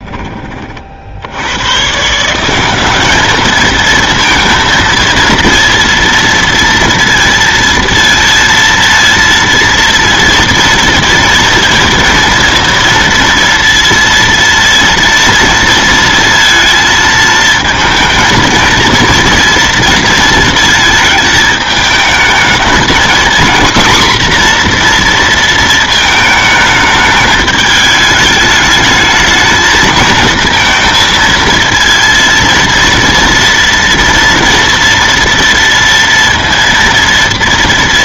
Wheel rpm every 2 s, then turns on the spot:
40, 180, 230, 230, 230, 230, 230, 230, 230, 230, 230, 230, 250, 220, 210, 230, 230, 230, 230.
none